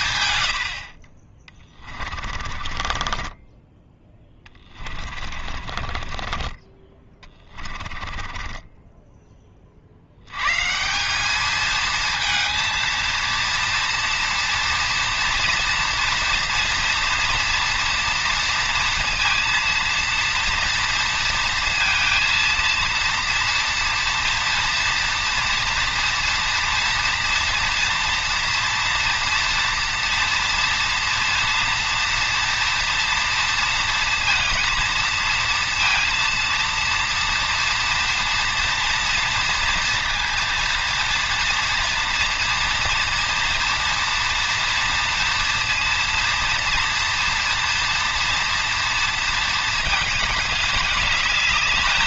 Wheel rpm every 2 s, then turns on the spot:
90, 40, 20, 20, 20, 130, 230, 230, 230, 230, 230, 230, 230, 230, 230, 230, 230, 230, 230, 240, 230, 240, 230, 240, 230, 210.
2-10